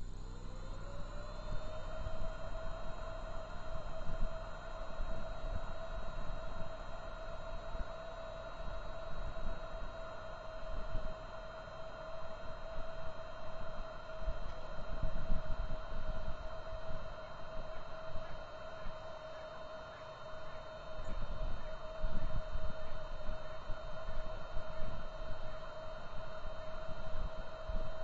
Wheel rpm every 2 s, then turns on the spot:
0, 0, 0, 0, 0, 0, 0, 0, 0, 0, 0, 0, 0, 0.
none